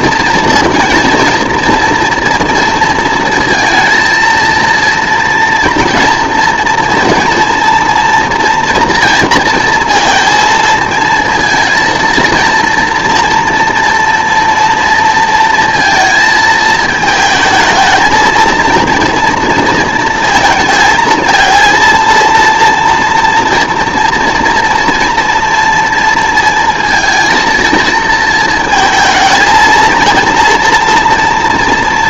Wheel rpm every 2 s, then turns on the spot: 230, 230, 230, 230, 230, 230, 230, 230, 220, 230, 230, 230, 230, 230, 230, 230.
none